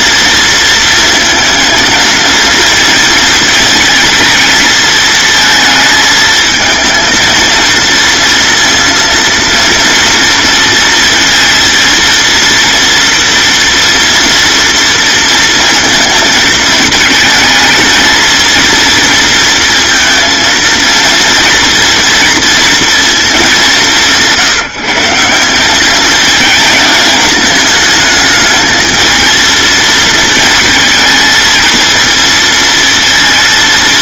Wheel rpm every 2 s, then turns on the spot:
230, 230, 220, 230, 230, 230, 240, 230, 220, 230, 230, 230, 160, 220, 220, 220, 230.
none